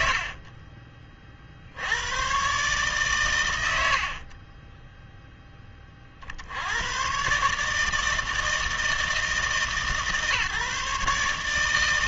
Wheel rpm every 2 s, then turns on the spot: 60, 130, 20, 90, 160, 140.
0-2 4-6